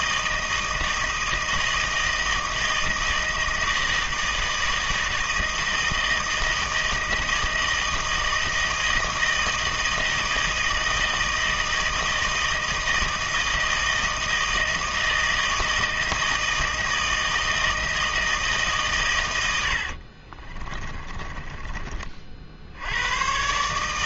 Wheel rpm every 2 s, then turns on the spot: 160, 160, 160, 160, 160, 160, 160, 160, 160, 140, 20, 80.
20-22